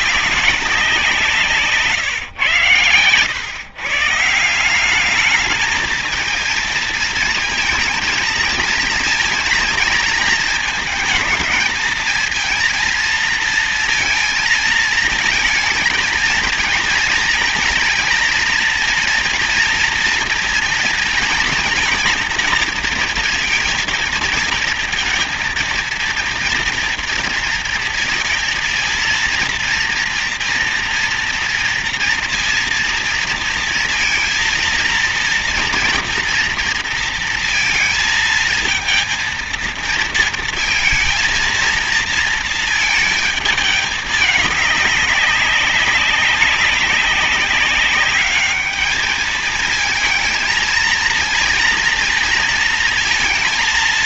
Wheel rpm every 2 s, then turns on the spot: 180, 120, 190, 220, 230, 220, 230, 230, 230, 230, 230, 230, 230, 230, 230, 230, 230, 230, 230, 230, 230, 220, 200, 200, 210, 230, 230.
none